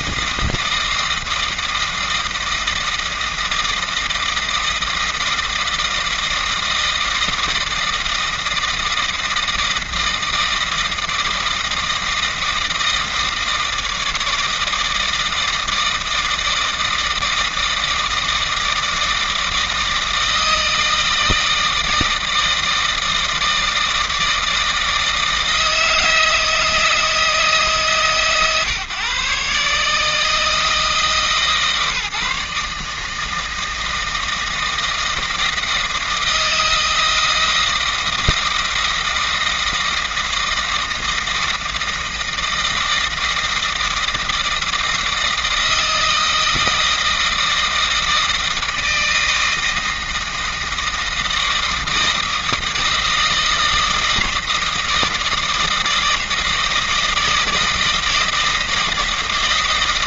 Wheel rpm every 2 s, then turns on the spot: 160, 160, 160, 160, 160, 160, 160, 160, 160, 160, 160, 160, 160, 160, 140, 150, 150, 160, 160, 160, 160, 160, 160, 160, 160, 160, 160, 160, 160, 160.
none